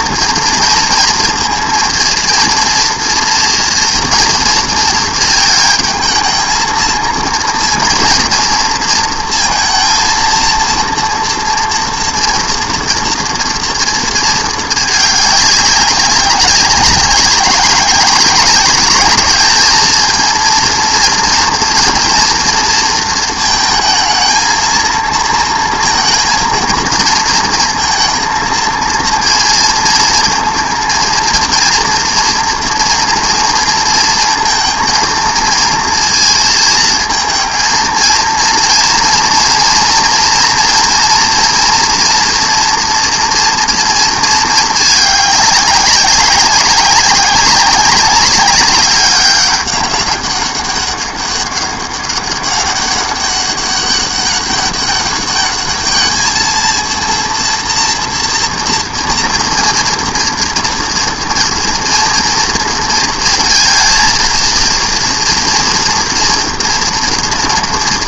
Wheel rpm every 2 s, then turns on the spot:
230, 230, 220, 220, 230, 230, 240, 210, 200, 200, 230, 230, 230, 230, 230, 230, 230, 230, 230, 230, 230, 230, 220, 190, 200, 200, 200, 200, 230, 230, 230, 230, 230, 230.
none